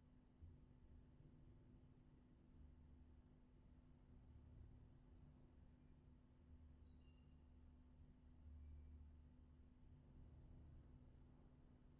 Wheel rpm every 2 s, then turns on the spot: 0, 0, 0, 0, 0, 0.
none